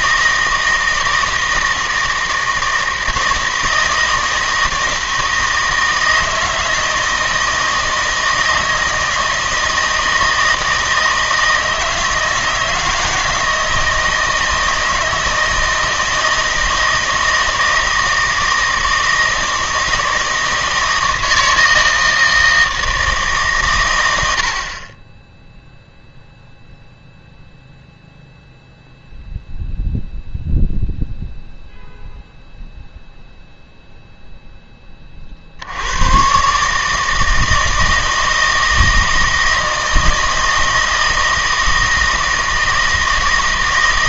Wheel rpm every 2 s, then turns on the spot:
160, 160, 160, 160, 160, 160, 160, 160, 160, 160, 160, 160, 60, 0, 0, 0, 0, 10, 140, 160, 160, 160.
none